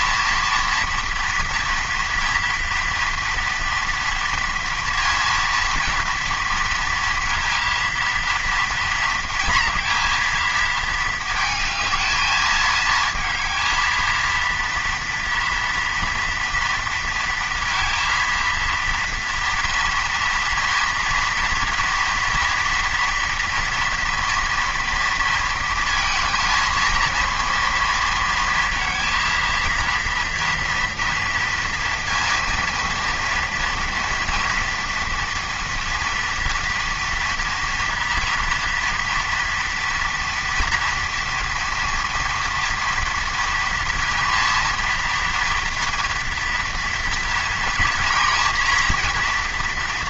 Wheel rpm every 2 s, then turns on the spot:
230, 230, 230, 230, 230, 220, 220, 230, 230, 230, 230, 230, 230, 230, 230, 230, 230, 240, 230, 230, 230, 230, 230, 230, 230.
none